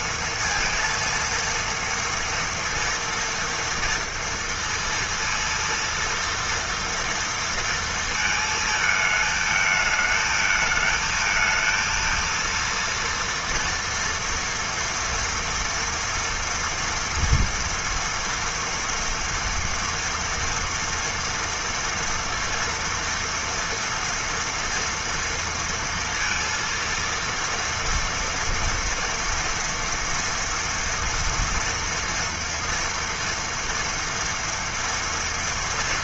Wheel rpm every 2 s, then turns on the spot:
230, 230, 230, 230, 220, 220, 230, 230, 230, 230, 230, 230, 230, 230, 230, 240, 240, 230.
none